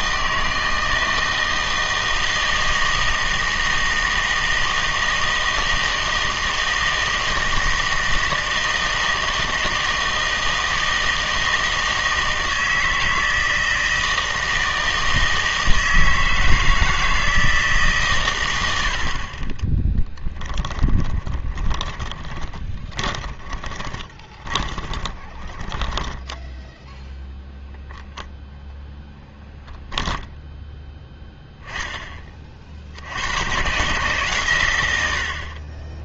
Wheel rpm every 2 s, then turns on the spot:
160, 160, 160, 160, 160, 160, 160, 160, 160, 90, 20, 20, 20, 10, 0, 10, 50, 120.
20-26